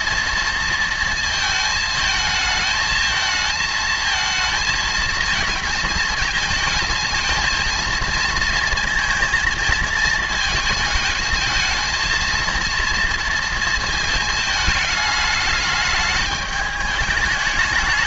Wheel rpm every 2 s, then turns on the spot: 230, 220, 220, 220, 230, 220, 230, 220, 210.
none